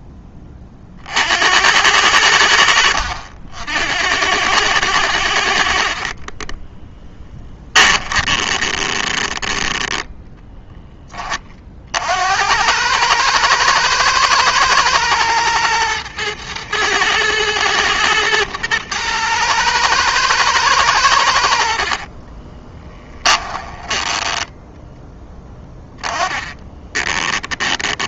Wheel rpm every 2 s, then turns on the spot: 40, 70, 90, 30, 20, 10, 100, 110, 110, 110, 100, 20, 10, 20.
2-4 6-10 22-24 26-28